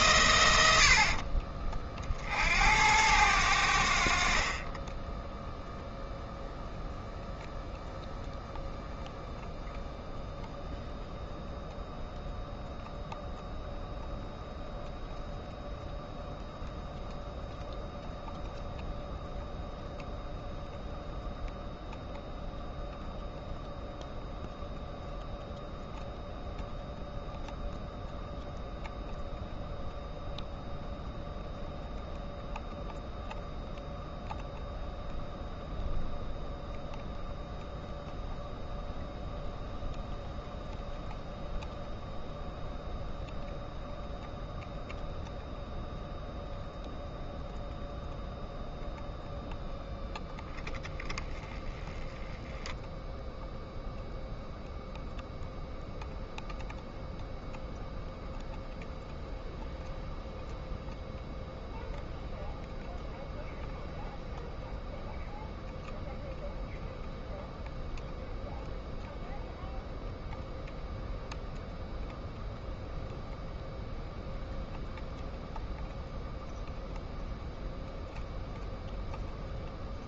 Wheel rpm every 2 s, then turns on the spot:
90, 80, 30, 0, 0, 0, 0, 0, 0, 0, 0, 0, 0, 0, 0, 0, 0, 0, 0, 0, 0, 0, 0, 0, 0, 10, 0, 0, 0, 0, 0, 0, 0, 0, 0, 0, 0, 0, 0, 0.
0-2